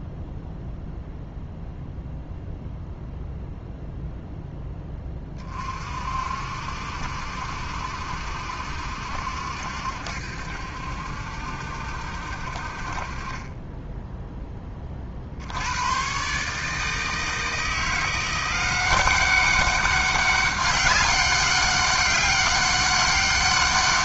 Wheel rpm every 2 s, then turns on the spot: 0, 0, 10, 60, 70, 70, 50, 40, 150, 180, 200, 200.
none